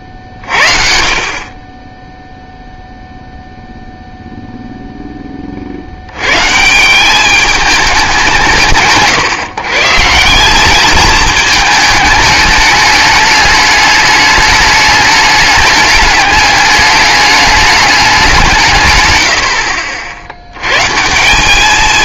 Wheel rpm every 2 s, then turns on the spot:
60, 0, 0, 130, 170, 180, 210, 210, 210, 170, 90.
none